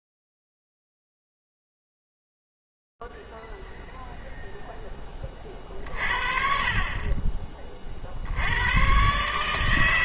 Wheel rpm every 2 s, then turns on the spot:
0, 0, 0, 50, 50.
none